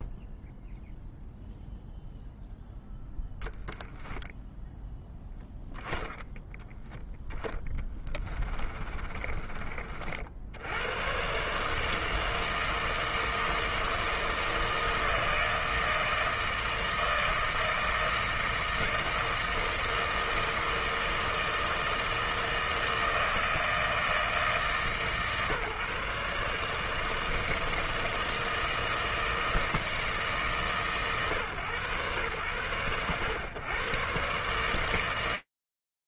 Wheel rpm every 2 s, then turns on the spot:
0, 0, 0, 0, 30, 100, 160, 160, 160, 160, 160, 160, 150, 150, 160, 150, 100, 150.
8-10